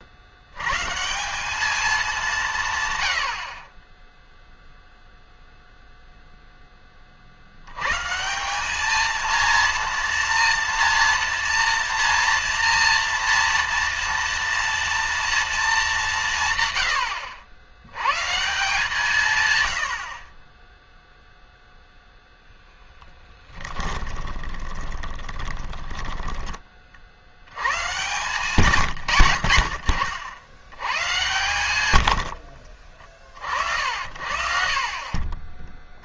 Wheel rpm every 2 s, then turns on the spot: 140, 130, 0, 20, 210, 230, 230, 240, 120, 150, 0, 10, 20, 30, 110, 110, 40, 40.
22-26 28-30 34-36